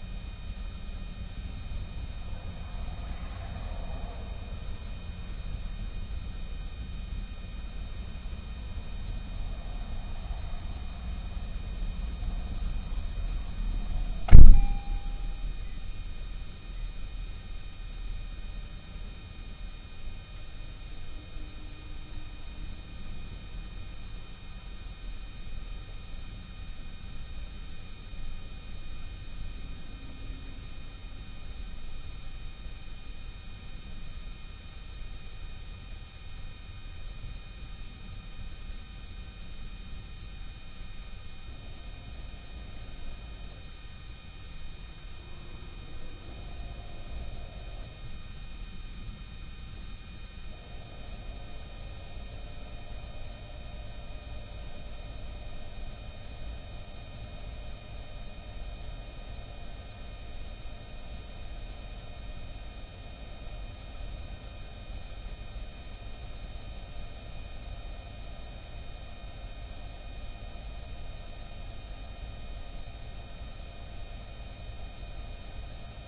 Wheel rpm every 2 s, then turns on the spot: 0, 0, 0, 0, 0, 0, 0, 0, 0, 0, 0, 0, 0, 0, 0, 0, 0, 0, 0, 0, 0, 0, 0, 0, 0, 0, 0, 0, 0, 0, 0, 0, 0, 0, 0, 0, 0, 0.
none